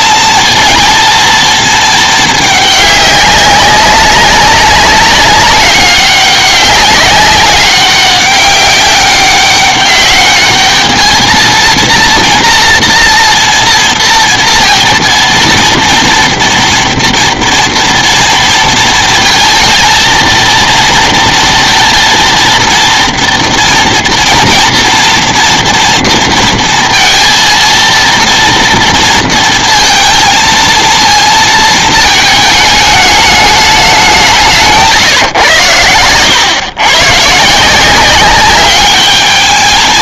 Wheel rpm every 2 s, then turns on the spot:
220, 210, 190, 200, 200, 200, 230, 230, 230, 230, 230, 230, 230, 230, 230, 230, 220, 180, 100, 190.
none